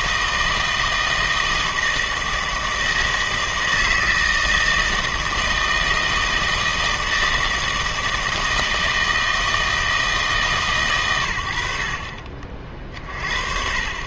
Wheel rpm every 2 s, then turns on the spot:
160, 160, 160, 160, 160, 130, 50.
none